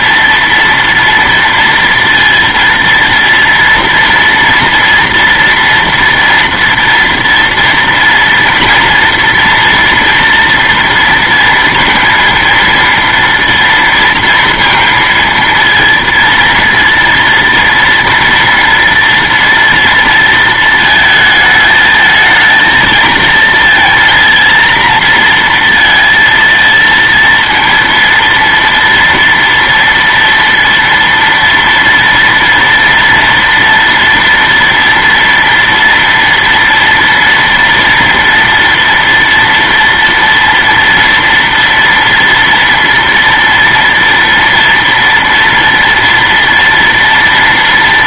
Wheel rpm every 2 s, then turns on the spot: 230, 230, 230, 230, 240, 230, 230, 230, 230, 240, 230, 220, 230, 230, 230, 230, 230, 230, 230, 230, 230, 230, 230, 230.
none